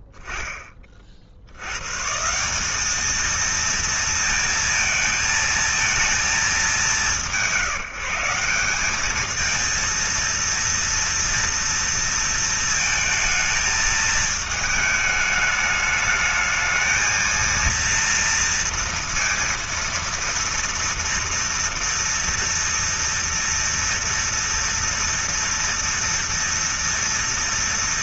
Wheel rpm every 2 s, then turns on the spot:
10, 140, 230, 210, 170, 230, 230, 220, 220, 230, 230, 230, 230, 230.
none